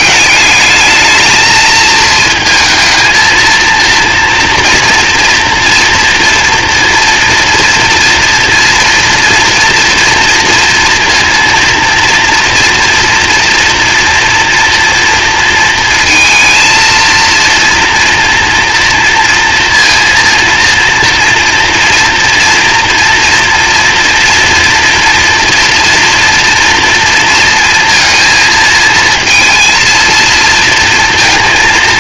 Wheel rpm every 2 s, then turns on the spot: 210, 220, 230, 240, 240, 230, 230, 230, 230, 230, 230, 230, 230, 230, 220, 230.
none